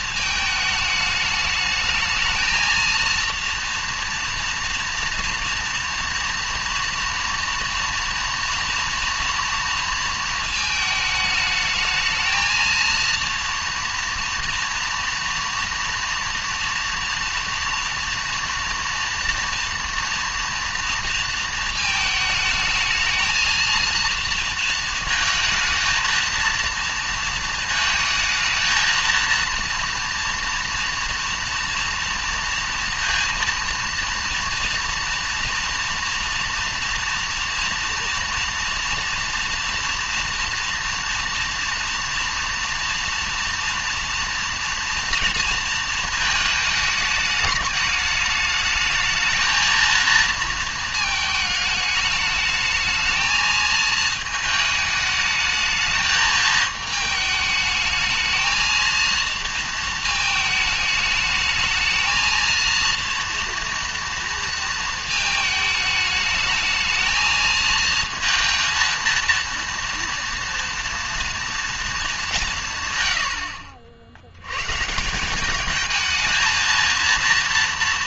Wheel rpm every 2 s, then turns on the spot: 210, 230, 230, 230, 230, 220, 220, 230, 230, 230, 230, 220, 230, 230, 220, 230, 230, 230, 230, 230, 230, 230, 230, 220, 220, 220, 220, 220, 220, 230, 220, 230, 230, 220, 230, 230, 130, 130, 230.
none